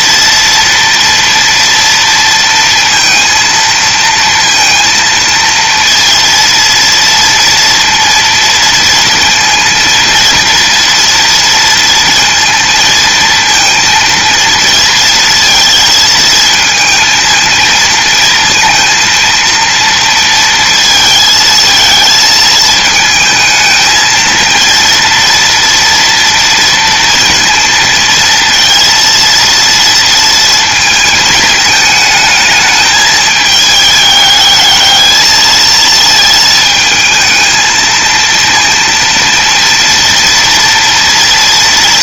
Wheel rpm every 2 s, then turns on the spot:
230, 230, 230, 230, 230, 230, 230, 230, 230, 230, 220, 220, 230, 230, 230, 220, 220, 220, 220, 230, 230.
none